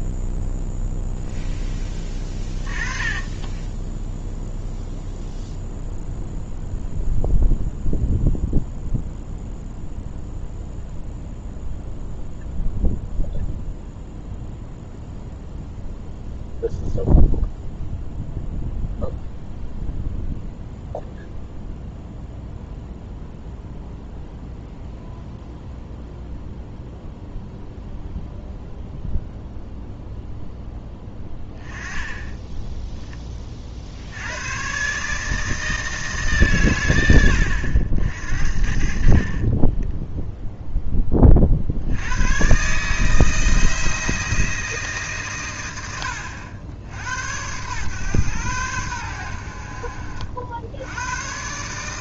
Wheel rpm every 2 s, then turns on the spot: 0, 20, 0, 0, 0, 0, 0, 0, 0, 0, 0, 0, 0, 0, 0, 10, 10, 140, 120, 50, 0, 140, 160, 80, 100, 80.
none